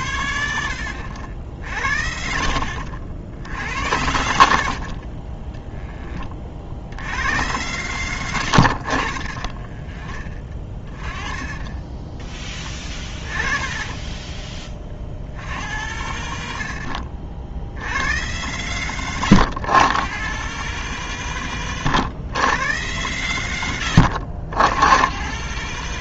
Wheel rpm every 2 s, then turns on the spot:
80, 60, 60, 50, 70, 30, 10, 30, 60, 110, 140, 110, 90.
4-6 8-10